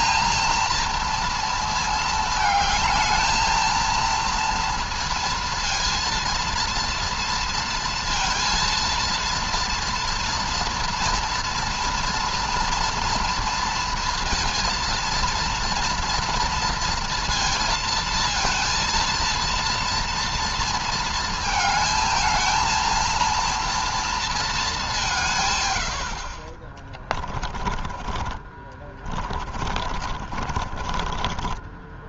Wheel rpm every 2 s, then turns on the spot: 230, 220, 230, 230, 230, 230, 230, 230, 230, 230, 230, 230, 200, 30, 30, 40.
26-32